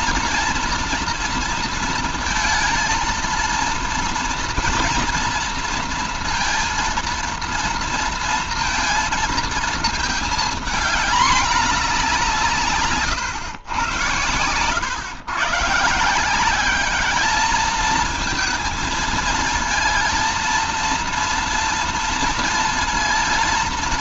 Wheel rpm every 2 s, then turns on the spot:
230, 230, 230, 230, 230, 220, 160, 100, 200, 220, 230, 230.
none